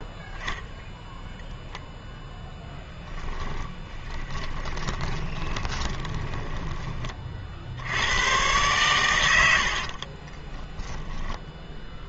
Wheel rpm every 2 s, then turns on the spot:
0, 10, 20, 20, 120, 10.
2-6 10-12